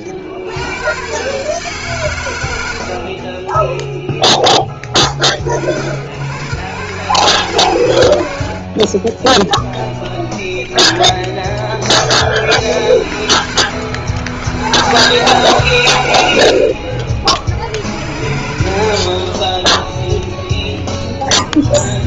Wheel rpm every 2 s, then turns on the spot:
100, 90, 10, 110, 40, 20, 20, 110, 70, 70, 10.
2-4 8-12 16-18 20-22